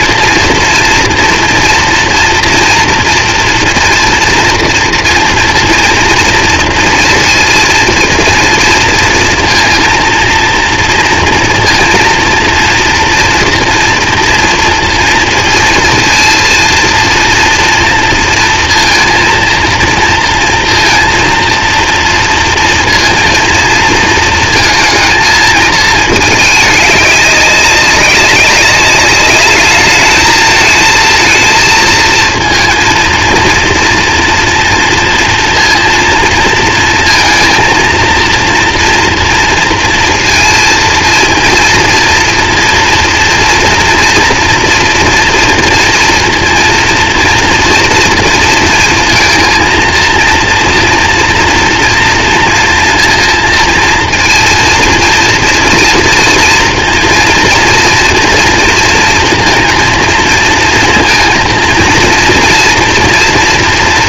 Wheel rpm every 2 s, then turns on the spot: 230, 230, 230, 230, 230, 230, 230, 230, 230, 230, 230, 230, 220, 200, 200, 230, 230, 230, 230, 230, 230, 230, 230, 230, 230, 230, 230, 230, 230, 230, 230, 230.
none